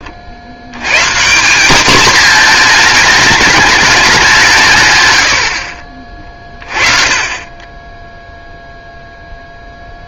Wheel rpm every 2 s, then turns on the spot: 80, 220, 160, 30, 0.
none